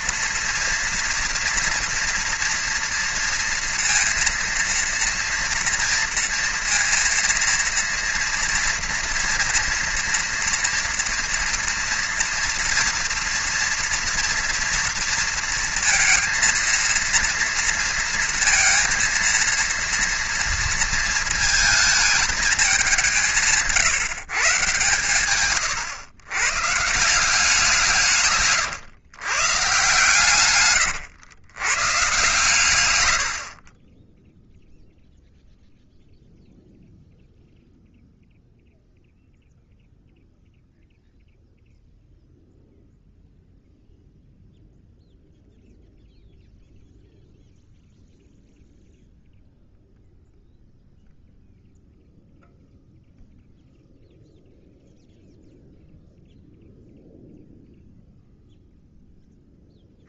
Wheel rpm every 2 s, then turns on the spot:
230, 230, 230, 230, 230, 230, 230, 230, 230, 230, 230, 210, 130, 120, 130, 130, 120, 0, 0, 0, 0, 0, 0, 0, 0, 0, 0, 0, 0, 0.
28-30